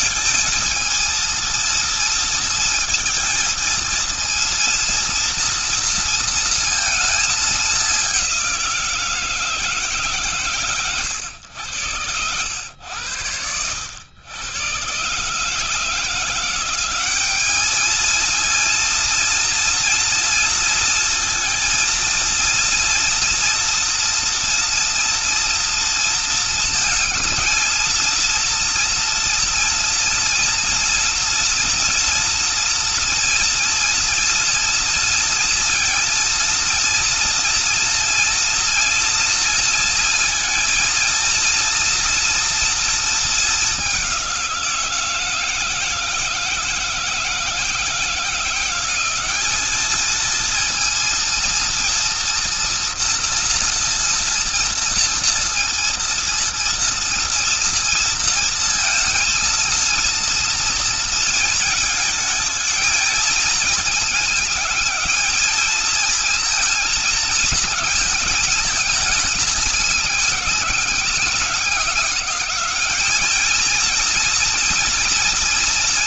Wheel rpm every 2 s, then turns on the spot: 230, 230, 230, 220, 180, 110, 90, 130, 200, 230, 230, 240, 230, 220, 230, 240, 230, 230, 230, 230, 230, 220, 170, 160, 190, 230, 240, 230, 230, 230, 230, 220, 220, 220, 220, 200, 210, 230.
none